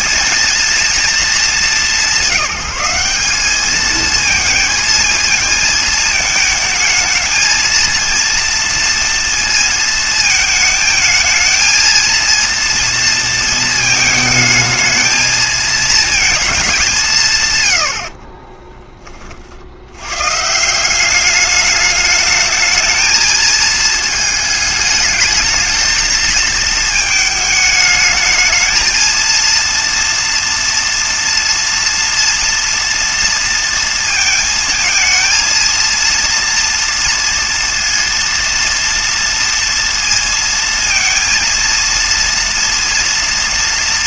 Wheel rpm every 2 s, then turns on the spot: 230, 180, 230, 220, 230, 220, 230, 220, 210, 20, 160, 220, 220, 220, 220, 230, 230, 220, 230, 230, 230, 230.
18-20